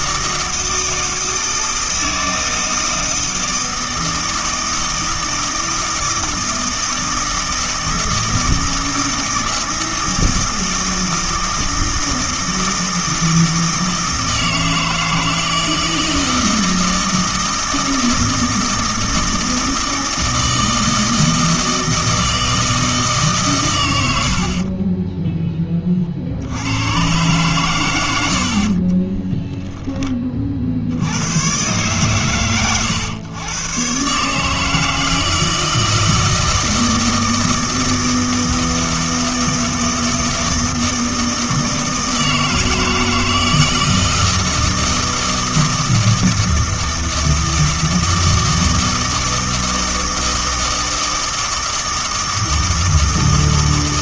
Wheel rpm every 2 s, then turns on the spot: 160, 160, 160, 160, 160, 160, 160, 160, 160, 160, 160, 160, 20, 100, 30, 60, 110, 160, 160, 160, 160, 160, 160, 160, 160, 160, 160.
24-26 28-30